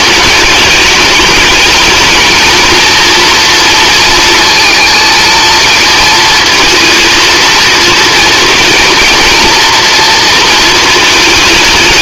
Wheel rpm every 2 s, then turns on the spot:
210, 230, 220, 230, 230, 220.
none